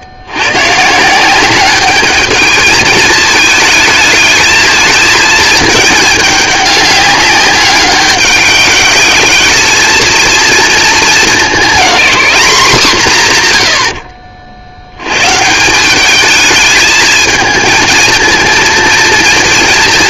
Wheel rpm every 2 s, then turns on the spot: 120, 210, 220, 200, 200, 220, 200, 70, 220, 230.
none